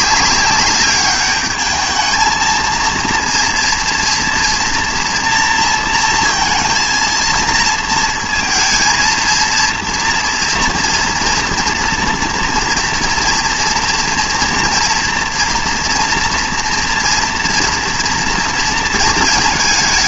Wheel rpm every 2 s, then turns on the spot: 200, 230, 230, 230, 230, 230, 230, 230, 240, 230.
none